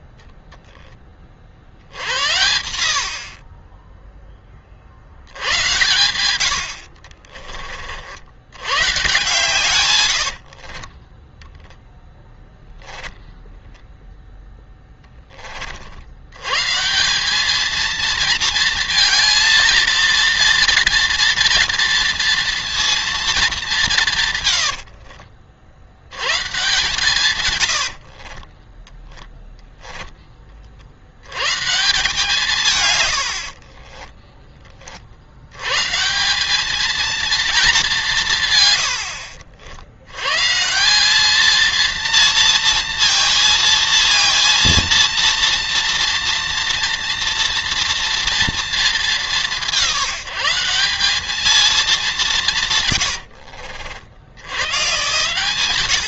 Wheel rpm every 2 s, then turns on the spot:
10, 90, 40, 90, 100, 50, 0, 0, 140, 230, 230, 230, 110, 140, 20, 40, 140, 30, 200, 130, 150, 230, 230, 230, 220, 180, 150, 110.
6-8 10-12 24-26 28-30 52-54